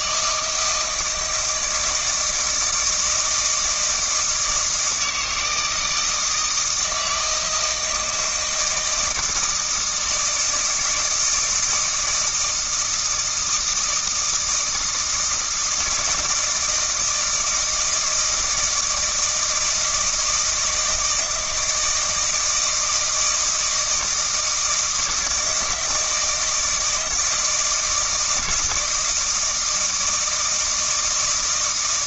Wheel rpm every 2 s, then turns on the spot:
160, 160, 160, 160, 160, 160, 160, 160, 160, 170, 160, 160, 160, 160, 160, 160.
none